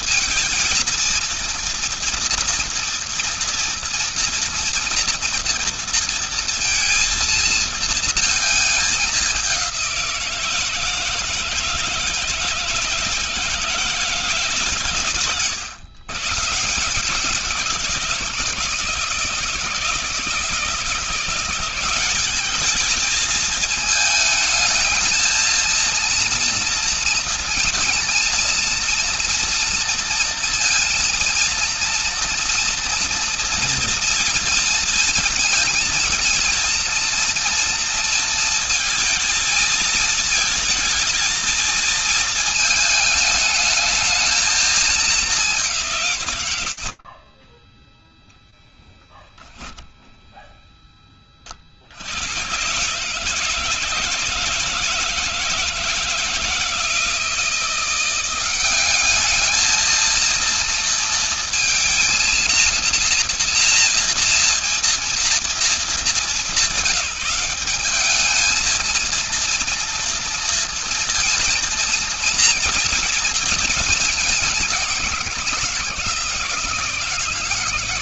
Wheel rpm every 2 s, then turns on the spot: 230, 230, 230, 230, 210, 160, 160, 130, 170, 160, 170, 220, 220, 230, 230, 230, 230, 230, 230, 230, 220, 220, 210, 50, 10, 20, 150, 160, 160, 200, 230, 230, 230, 190, 230, 230, 220, 180, 160.
48-50